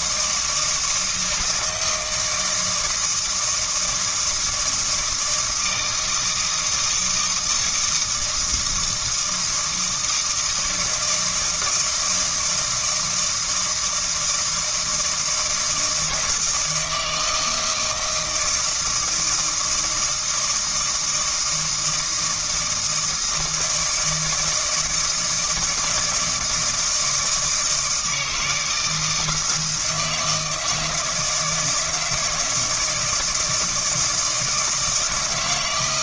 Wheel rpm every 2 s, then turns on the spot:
160, 160, 170, 160, 160, 160, 160, 160, 160, 160, 160, 160, 160, 160, 160, 160, 160, 160.
none